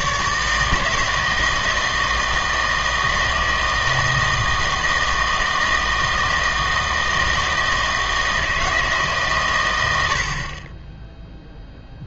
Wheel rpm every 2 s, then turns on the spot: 160, 160, 160, 160, 160, 30.
none